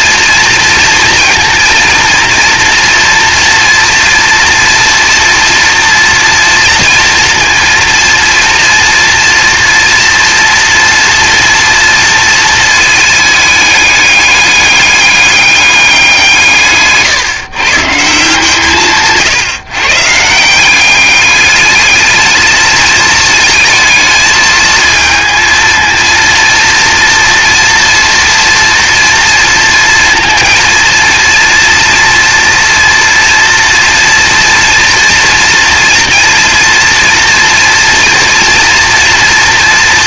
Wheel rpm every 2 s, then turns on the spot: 230, 230, 230, 230, 230, 230, 230, 200, 150, 160, 190, 220, 220, 230, 230, 230, 230, 240, 240, 240.
none